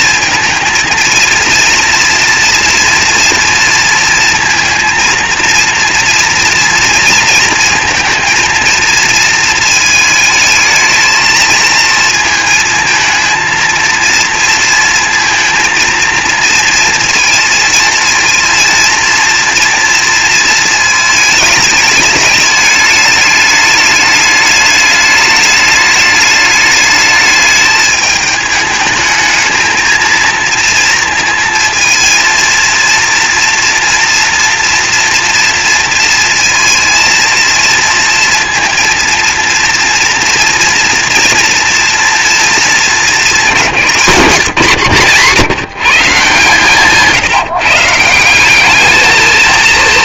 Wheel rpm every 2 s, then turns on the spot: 230, 230, 230, 230, 230, 220, 220, 230, 230, 230, 230, 210, 210, 210, 220, 230, 230, 240, 230, 230, 230, 220, 150, 150, 200.
none